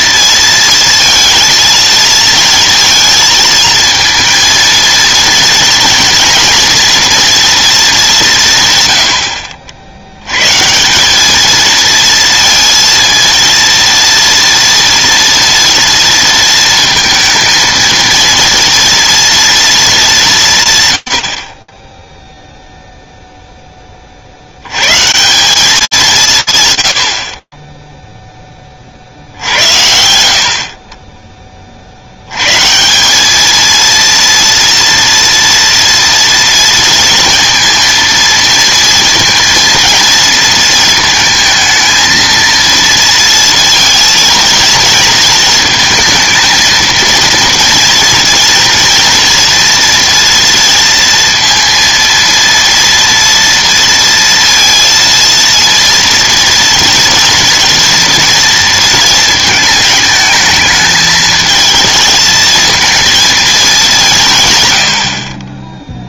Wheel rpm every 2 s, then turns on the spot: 230, 230, 230, 230, 140, 140, 230, 230, 230, 230, 140, 0, 110, 100, 50, 30, 200, 230, 230, 230, 220, 230, 230, 230, 240, 230, 230, 230, 230, 230, 220, 230, 50.
none